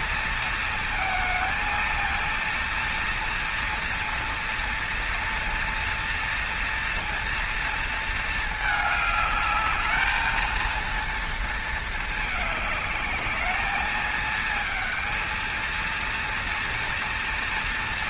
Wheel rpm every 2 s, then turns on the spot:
220, 230, 230, 230, 210, 230, 210, 220, 230.
none